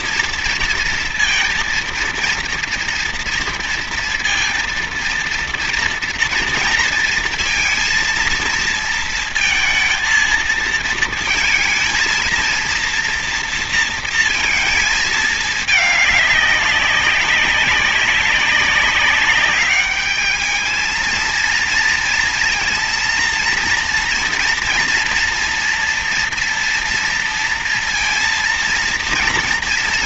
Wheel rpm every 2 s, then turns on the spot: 230, 230, 230, 230, 230, 230, 230, 230, 210, 200, 210, 230, 240, 230, 230.
none